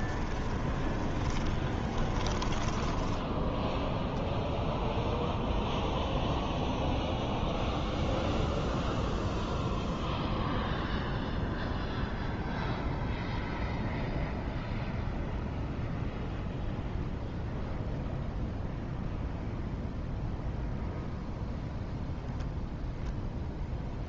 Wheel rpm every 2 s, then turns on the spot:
20, 10, 0, 0, 0, 0, 0, 0, 0, 0, 0, 0.
0-2